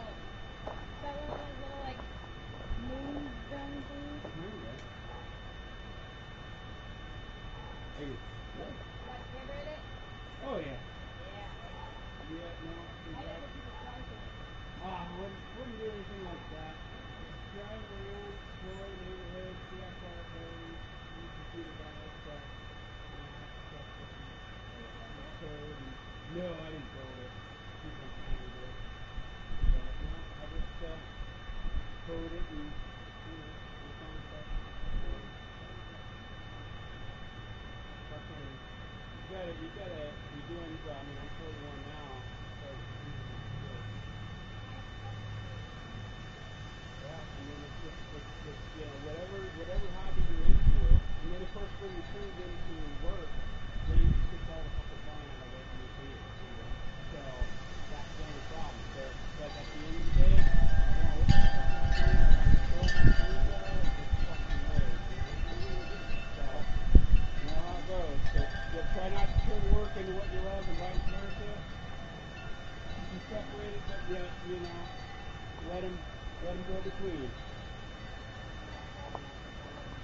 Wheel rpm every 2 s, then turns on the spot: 0, 0, 0, 0, 0, 0, 0, 0, 0, 0, 0, 0, 0, 0, 0, 0, 0, 0, 0, 0, 0, 0, 0, 0, 0, 0, 0, 0, 0, 0, 0, 0, 0, 0, 0, 0, 0, 0, 0, 0.
none